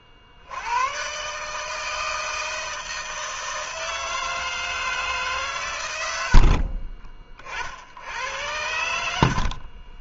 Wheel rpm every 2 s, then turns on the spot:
90, 160, 160, 30, 90.
none